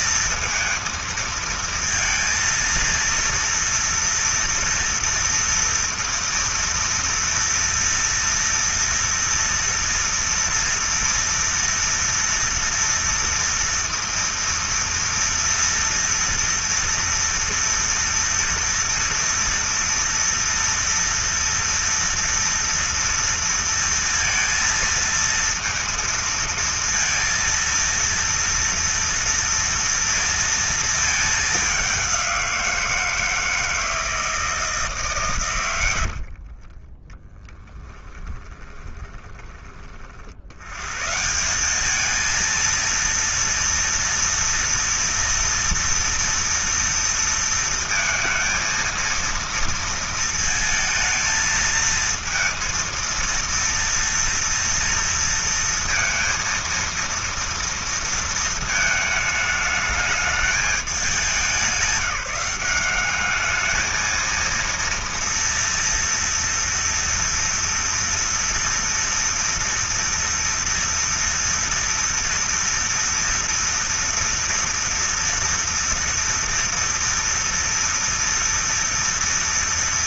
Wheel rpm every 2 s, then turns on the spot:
230, 230, 230, 230, 230, 230, 230, 230, 230, 230, 230, 230, 230, 230, 230, 210, 160, 150, 20, 20, 140, 230, 230, 230, 230, 220, 230, 230, 230, 220, 200, 200, 230, 230, 230, 240, 230, 230, 230, 230.
36-40